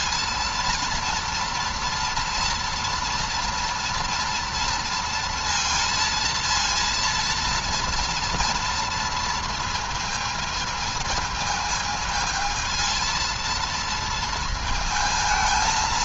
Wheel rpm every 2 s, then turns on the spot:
230, 230, 230, 230, 230, 220, 220, 220.
none